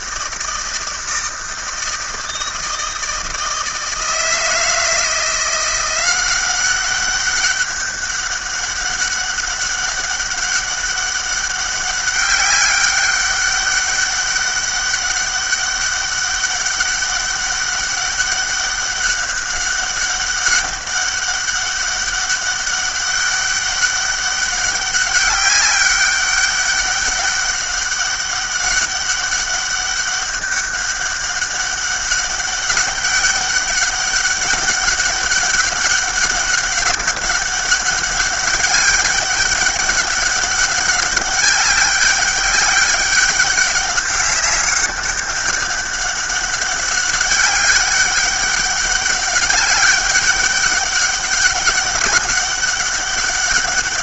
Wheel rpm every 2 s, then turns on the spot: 160, 160, 160, 190, 200, 200, 200, 200, 200, 200, 200, 200, 200, 200, 200, 200, 200, 190, 200, 200, 200, 200, 200, 200, 200, 200, 200.
none